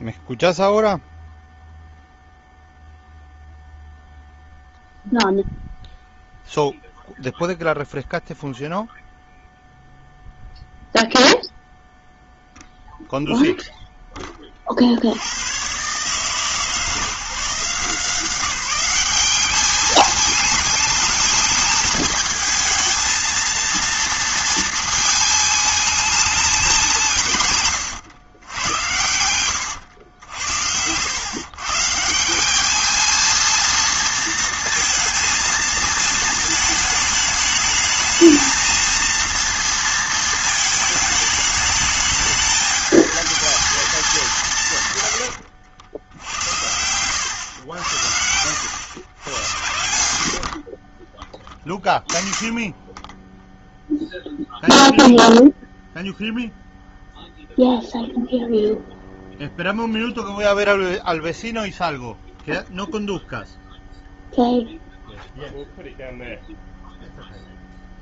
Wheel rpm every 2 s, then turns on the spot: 0, 0, 0, 0, 0, 0, 0, 50, 140, 190, 210, 220, 220, 190, 110, 80, 210, 230, 220, 220, 220, 220, 140, 90, 100, 40, 20, 0, 0, 0, 0, 0, 0, 0.
46-48